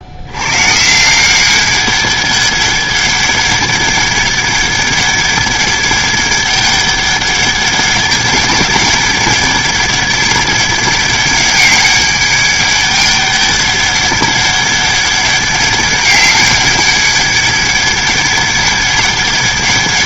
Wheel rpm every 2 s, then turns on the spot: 160, 200, 200, 200, 200, 200, 200, 200, 200, 200.
none